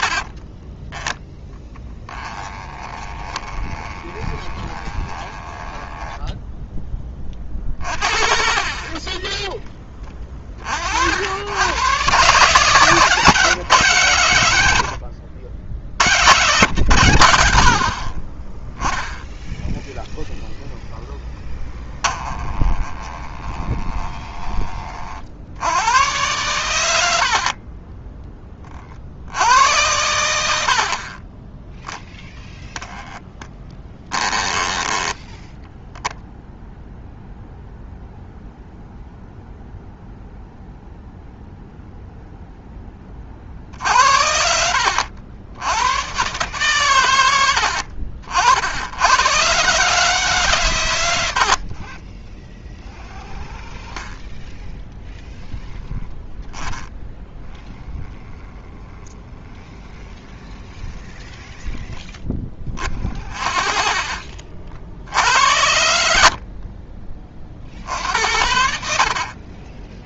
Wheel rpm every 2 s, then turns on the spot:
20, 20, 20, 10, 30, 50, 160, 90, 140, 10, 0, 20, 30, 100, 40, 60, 10, 10, 0, 0, 0, 10, 80, 120, 80, 120, 30, 10, 10, 10, 10, 40, 60, 40, 60.
0-6 22-24 30-32 34-36 62-64 66-68